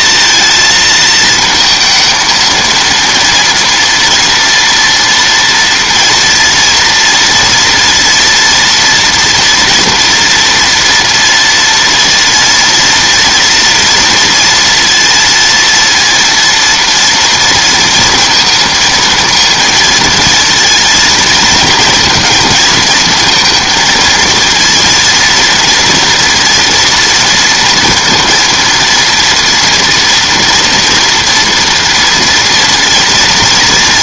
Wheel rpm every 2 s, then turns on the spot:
220, 230, 240, 230, 230, 230, 230, 230, 230, 230, 230, 230, 230, 240, 230, 240, 230.
none